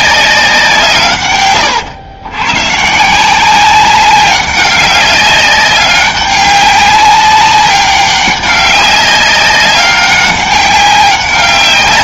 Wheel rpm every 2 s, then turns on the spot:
160, 130, 200, 200, 200, 190.
none